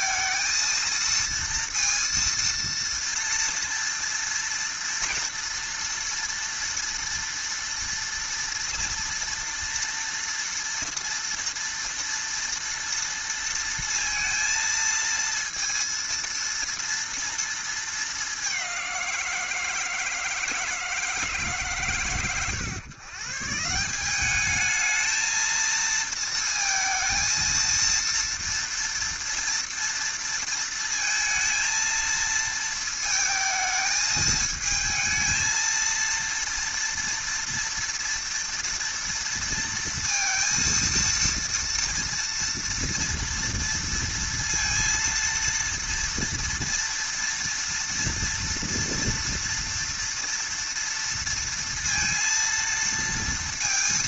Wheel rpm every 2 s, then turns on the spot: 230, 230, 240, 230, 240, 230, 230, 230, 230, 180, 160, 130, 220, 220, 230, 230, 220, 220, 230, 230, 230, 230, 230, 230, 230, 230, 230.
none